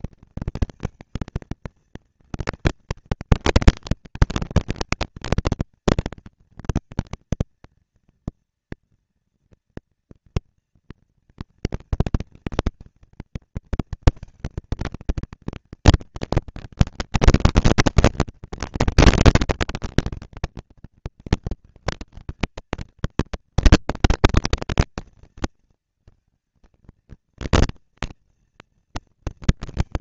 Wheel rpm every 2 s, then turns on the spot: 230, 230, 230, 230, 240, 230, 230, 230, 230, 230, 230, 230, 230, 230, 230.
none